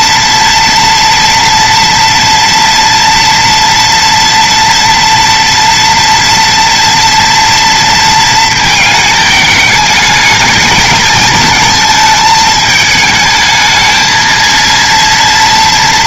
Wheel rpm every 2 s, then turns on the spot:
230, 230, 240, 230, 220, 220, 220, 230.
none